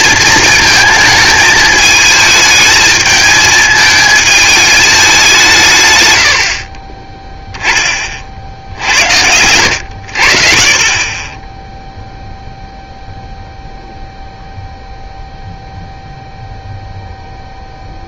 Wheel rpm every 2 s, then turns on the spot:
220, 210, 220, 50, 70, 30, 0, 0, 0.
none